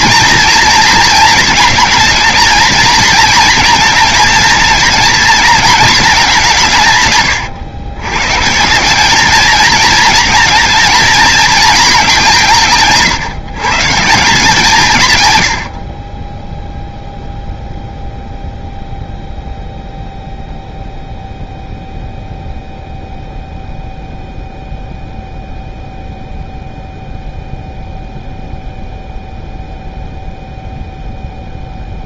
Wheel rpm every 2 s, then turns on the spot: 230, 230, 220, 170, 170, 230, 150, 160, 0, 0, 0, 0, 0, 0, 0, 0.
none